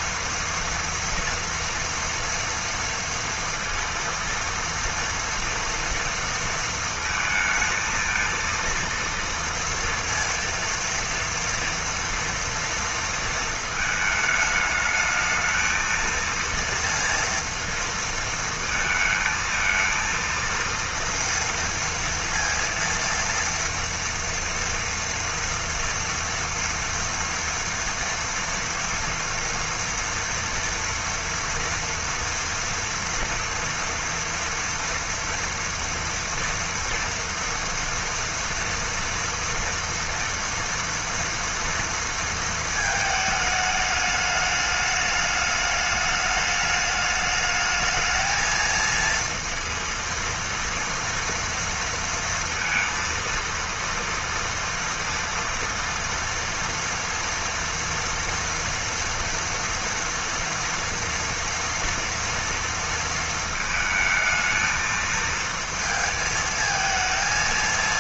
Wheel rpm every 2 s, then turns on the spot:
240, 230, 230, 230, 230, 230, 230, 220, 230, 220, 230, 230, 230, 230, 230, 230, 230, 230, 230, 230, 240, 230, 210, 210, 220, 230, 230, 230, 230, 230, 230, 230, 220, 220.
none